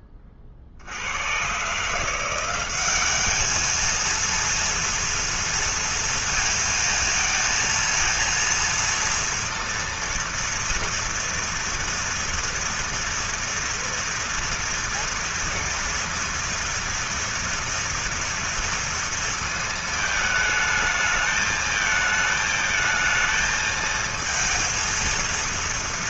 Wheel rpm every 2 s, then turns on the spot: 70, 200, 230, 230, 230, 230, 230, 230, 230, 230, 220, 220, 230.
none